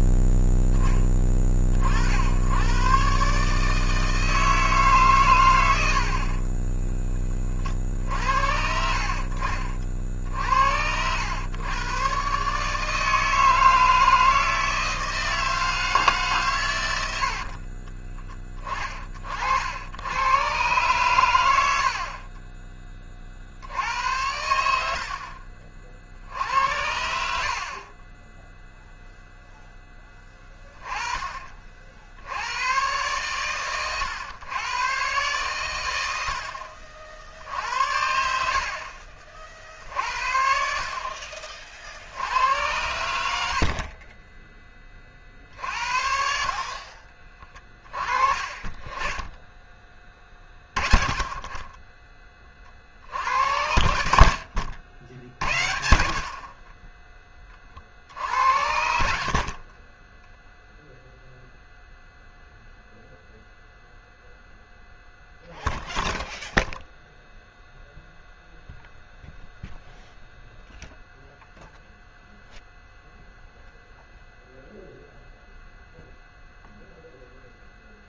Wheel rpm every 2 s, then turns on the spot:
10, 110, 150, 20, 60, 70, 150, 160, 100, 30, 120, 20, 70, 80, 0, 30, 110, 120, 70, 70, 60, 100, 20, 40, 30, 30, 50, 60, 30, 70, 0, 0, 0, 0, 0, 0, 0, 0, 0.
6-8